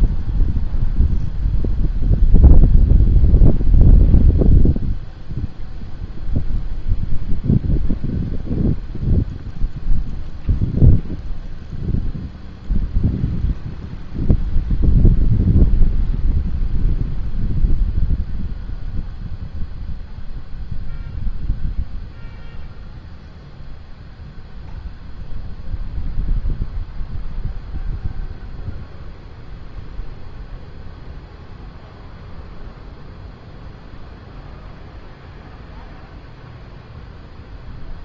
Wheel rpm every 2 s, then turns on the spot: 0, 0, 0, 0, 0, 0, 0, 0, 0, 0, 0, 0, 0, 0, 0, 0, 0, 0, 0.
none